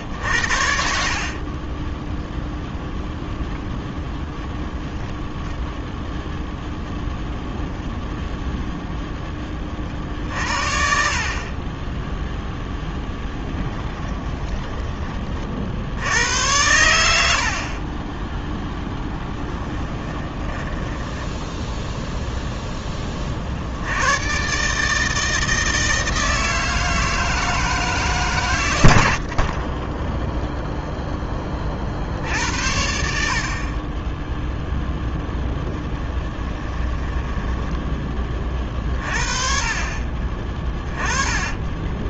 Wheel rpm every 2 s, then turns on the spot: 60, 10, 10, 0, 0, 50, 0, 30, 90, 0, 10, 10, 150, 160, 80, 10, 80, 10, 20, 60, 20.
0-2 20-22 28-30 34-38 40-42